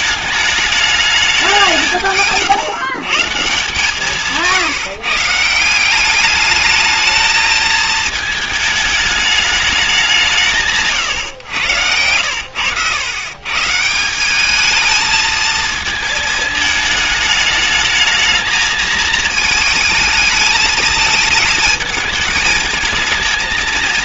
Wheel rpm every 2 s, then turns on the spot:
210, 140, 150, 210, 220, 120, 100, 220, 220, 220, 220, 220.
none